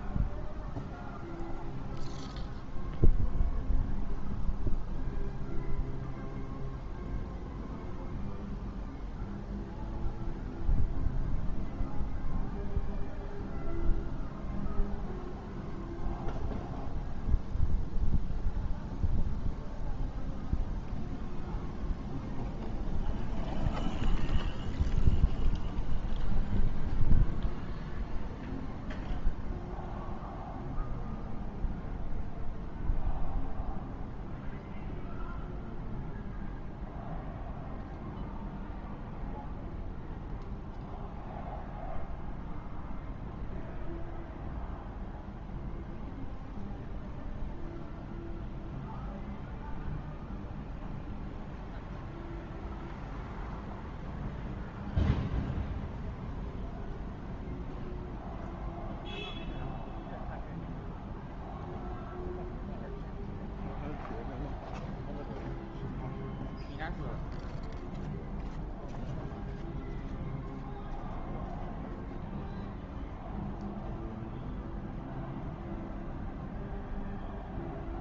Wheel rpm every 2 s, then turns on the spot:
0, 0, 0, 0, 0, 0, 0, 0, 0, 0, 0, 0, 0, 0, 0, 0, 0, 0, 0, 0, 0, 0, 0, 0, 0, 0, 0, 0, 0, 0, 0, 0, 0, 0, 0, 0, 0, 0, 0.
none